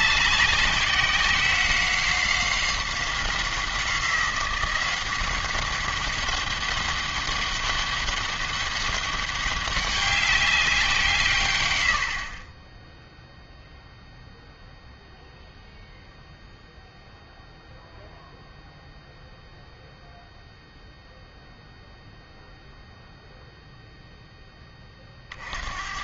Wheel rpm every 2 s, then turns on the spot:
190, 190, 180, 200, 200, 180, 10, 0, 0, 0, 0, 0, 20.
none